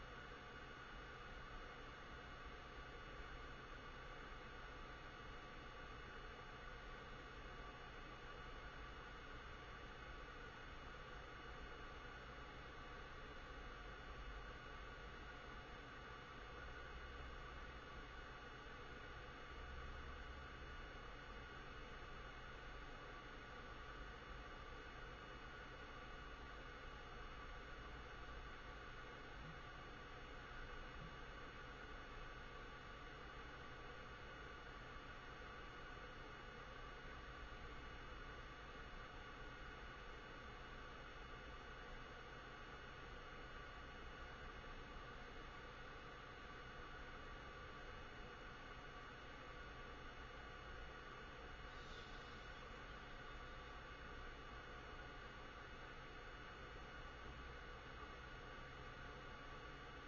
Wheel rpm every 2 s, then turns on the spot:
0, 0, 0, 0, 0, 0, 0, 0, 0, 0, 0, 0, 0, 0, 0, 0, 0, 0, 0, 0, 0, 0, 0, 0, 0, 0, 0, 0, 0, 0.
none